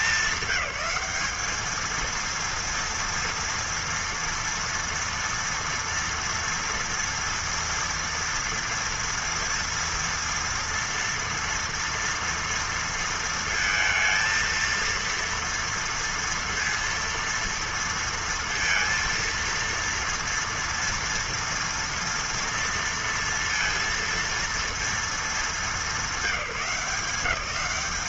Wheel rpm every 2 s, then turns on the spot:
210, 230, 230, 230, 230, 230, 230, 230, 230, 230, 230, 240, 230, 190.
none